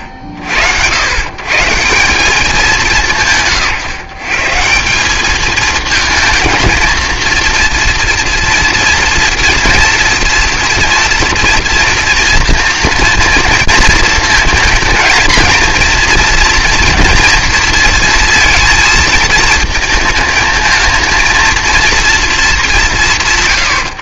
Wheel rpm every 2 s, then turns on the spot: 70, 190, 170, 220, 230, 230, 230, 230, 230, 230, 220, 170.
none